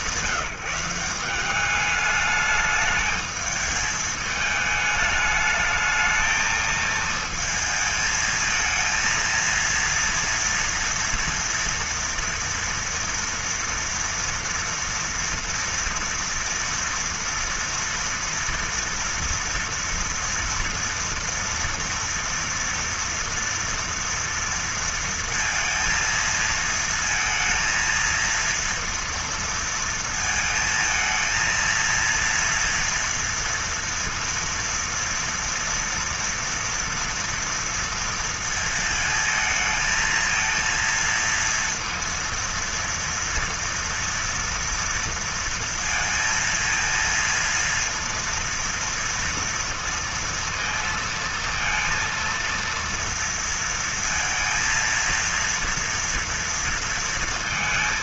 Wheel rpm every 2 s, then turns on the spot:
190, 210, 210, 220, 220, 230, 230, 230, 230, 230, 230, 240, 230, 230, 230, 220, 230, 230, 230, 230, 230, 230, 230, 230, 230, 230, 230, 230, 230.
none